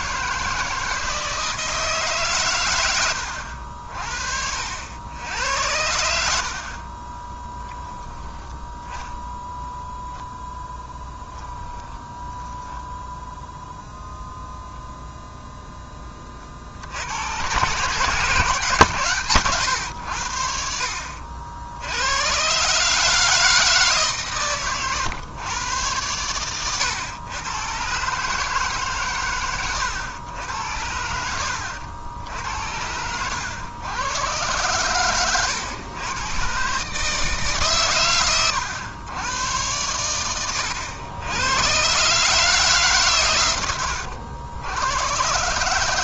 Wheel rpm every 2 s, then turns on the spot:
160, 100, 80, 40, 10, 10, 0, 0, 60, 140, 60, 150, 110, 110, 140, 70, 80, 110, 150, 110, 100, 140, 110.
10-12